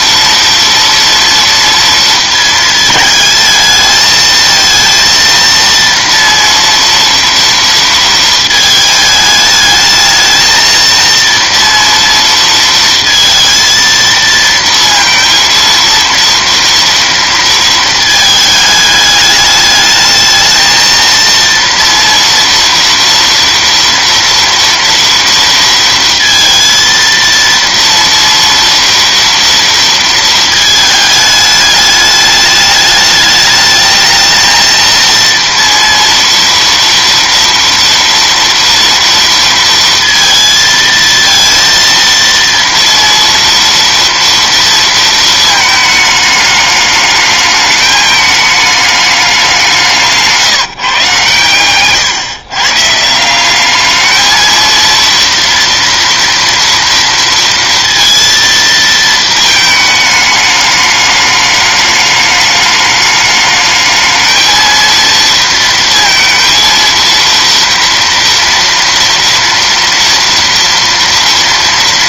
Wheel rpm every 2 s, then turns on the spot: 230, 220, 230, 230, 220, 230, 230, 230, 230, 220, 220, 230, 230, 230, 230, 220, 210, 230, 230, 230, 230, 230, 230, 210, 210, 160, 140, 220, 230, 230, 210, 210, 220, 230, 230, 230.
none